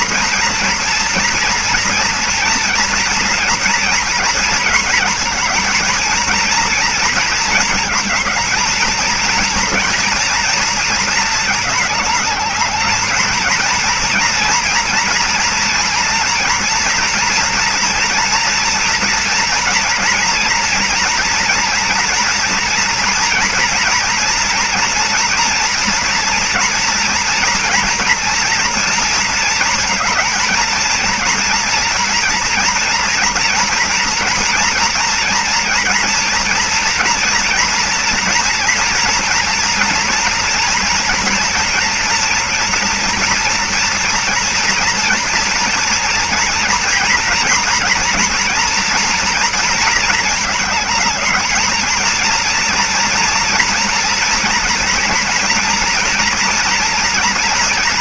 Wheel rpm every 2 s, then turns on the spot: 240, 230, 230, 230, 220, 230, 210, 230, 240, 230, 230, 230, 230, 240, 230, 230, 230, 230, 230, 230, 240, 230, 230, 230, 230, 220, 230, 240, 240.
none